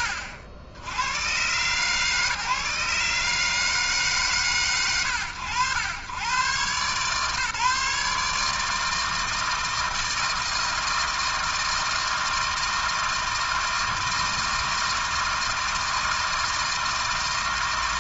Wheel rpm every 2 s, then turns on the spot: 80, 140, 80, 140, 160, 160, 160, 160, 160.
none